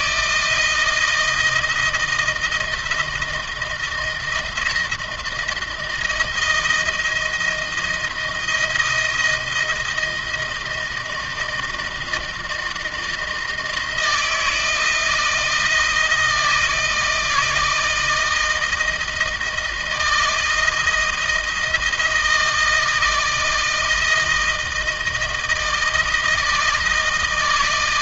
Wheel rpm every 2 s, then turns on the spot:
160, 170, 160, 170, 160, 160, 160, 160, 160, 160, 160, 160, 160, 160.
none